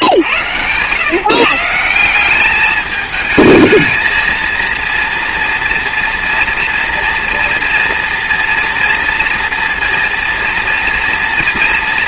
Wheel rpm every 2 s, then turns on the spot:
120, 210, 230, 230, 230, 230.
none